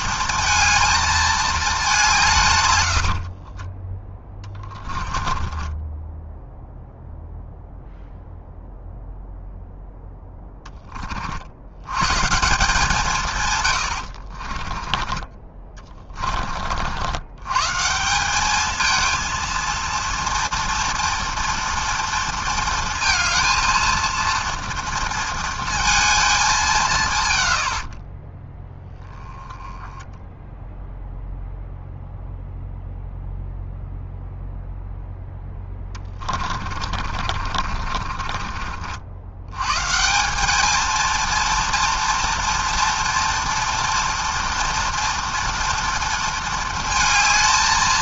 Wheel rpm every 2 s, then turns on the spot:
220, 130, 20, 0, 0, 10, 180, 40, 40, 200, 230, 230, 230, 200, 10, 0, 0, 0, 30, 40, 200, 230, 230, 230.
4-6 14-16 36-40